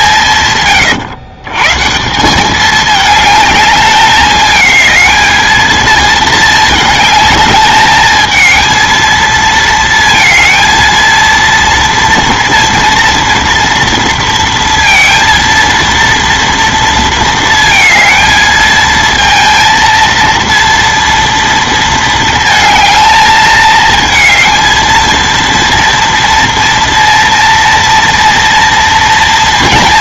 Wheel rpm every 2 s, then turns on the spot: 130, 200, 220, 220, 220, 230, 230, 230, 230, 220, 230, 220, 220, 230, 230.
none